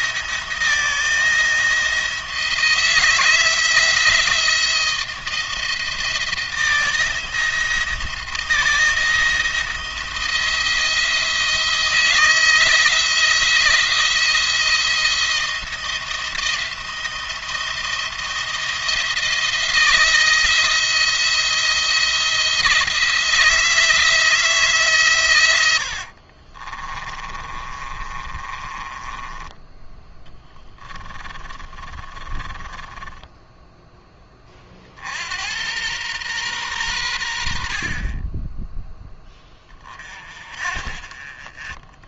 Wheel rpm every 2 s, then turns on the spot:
170, 170, 170, 160, 170, 170, 170, 170, 170, 170, 170, 170, 160, 40, 30, 10, 20, 40, 110, 10, 40.
26-34